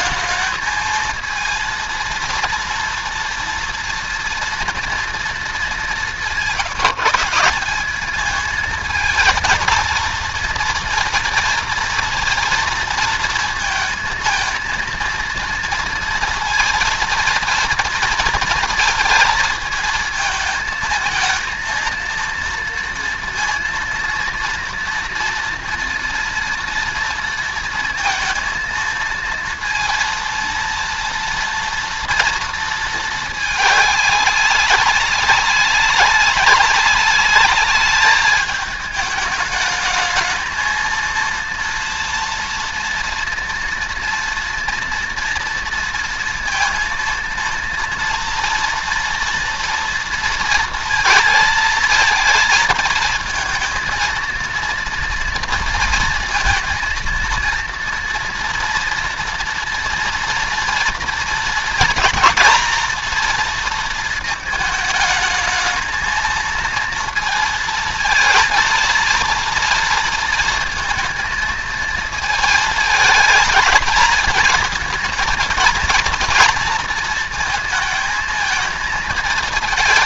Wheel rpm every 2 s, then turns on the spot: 220, 230, 230, 160, 220, 230, 230, 230, 230, 230, 220, 230, 230, 230, 230, 230, 220, 200, 200, 210, 220, 230, 230, 230, 230, 230, 220, 230, 230, 240, 230, 230, 220, 230, 230, 230, 220, 220, 230, 220.
none